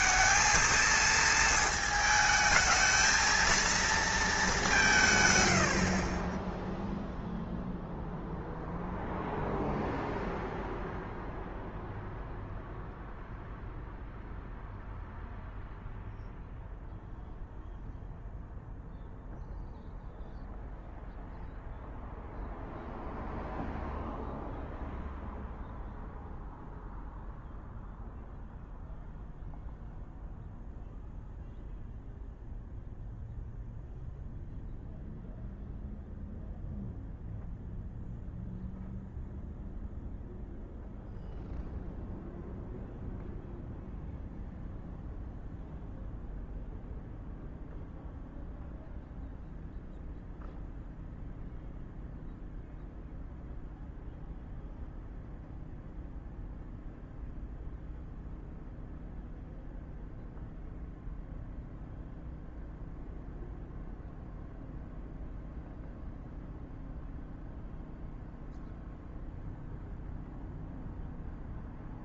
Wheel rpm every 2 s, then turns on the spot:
220, 220, 150, 0, 0, 0, 0, 0, 0, 0, 0, 0, 0, 0, 0, 0, 0, 0, 0, 0, 0, 0, 0, 0, 0, 0, 0, 0, 0, 0, 0, 0, 0, 0, 0, 0.
none